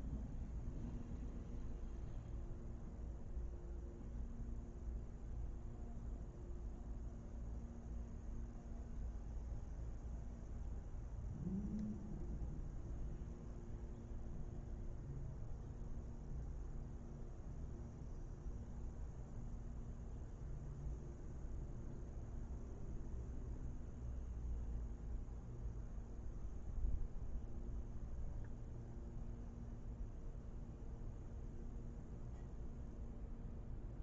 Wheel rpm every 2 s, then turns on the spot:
0, 0, 0, 0, 0, 0, 0, 0, 0, 0, 0, 0, 0, 0, 0, 0, 0.
none